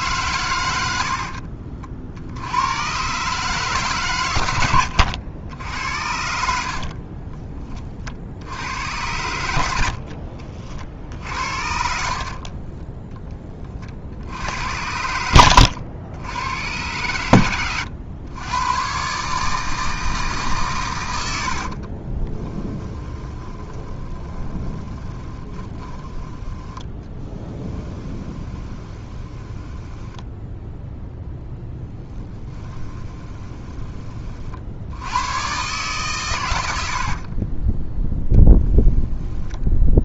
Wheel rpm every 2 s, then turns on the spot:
100, 100, 100, 40, 90, 50, 20, 80, 100, 130, 100, 10, 20, 10, 20, 0, 20, 80, 70, 10.
6-8 12-14 22-30 32-34 36-40